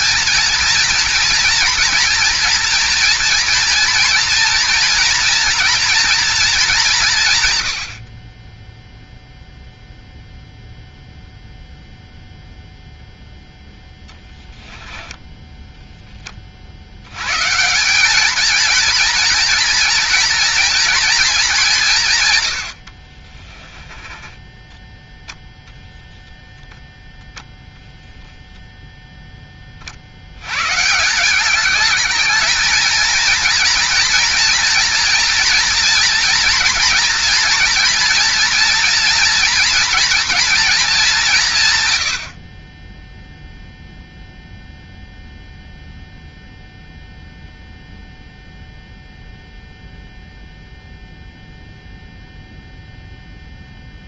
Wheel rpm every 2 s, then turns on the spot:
230, 230, 230, 210, 10, 0, 0, 10, 40, 230, 230, 100, 10, 0, 0, 120, 220, 230, 240, 230, 230, 50, 0, 0, 0, 0, 0.
14-16